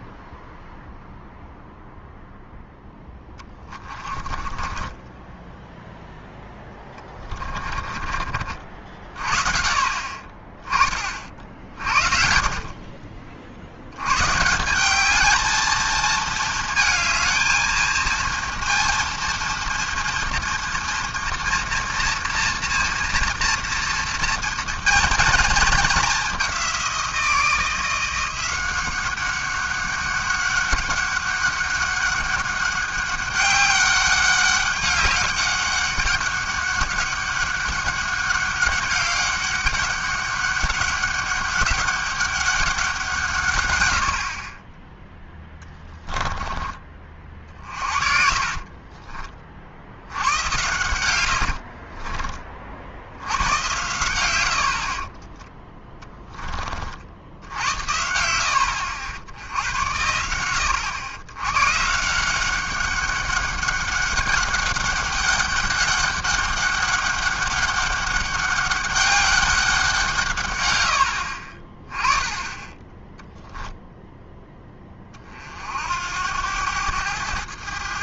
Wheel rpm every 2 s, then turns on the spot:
0, 0, 20, 10, 40, 20, 50, 160, 220, 230, 230, 230, 230, 190, 180, 200, 200, 200, 190, 200, 200, 190, 30, 20, 40, 100, 40, 80, 20, 70, 100, 190, 200, 200, 200, 110, 20, 10, 100.
4-8 44-46 48-50